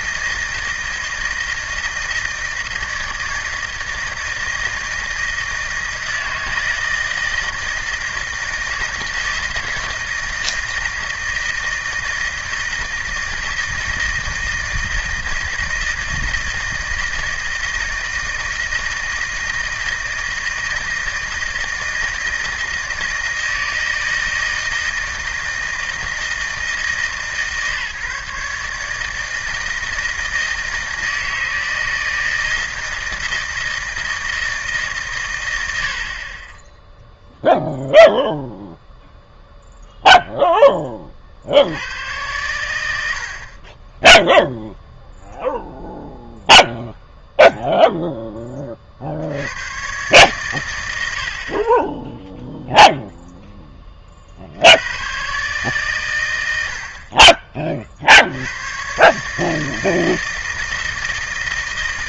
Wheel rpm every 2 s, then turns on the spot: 160, 160, 160, 160, 160, 160, 160, 160, 160, 160, 160, 160, 160, 160, 150, 160, 160, 160, 10, 0, 10, 100, 0, 0, 30, 110, 0, 70, 80, 100, 160.
none